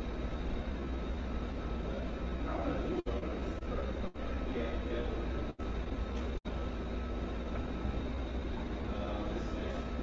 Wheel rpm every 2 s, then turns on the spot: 0, 0, 0, 0, 0.
none